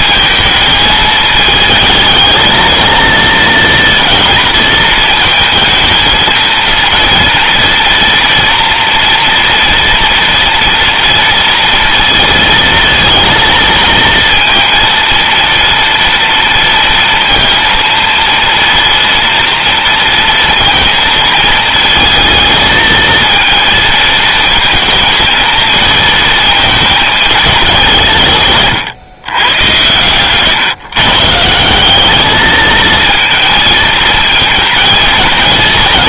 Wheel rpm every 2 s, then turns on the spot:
220, 220, 220, 230, 230, 230, 230, 230, 230, 230, 230, 230, 230, 220, 140, 140, 220, 220.
none